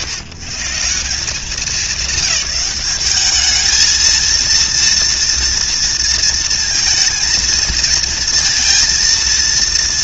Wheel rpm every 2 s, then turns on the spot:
90, 200, 230, 230, 230.
none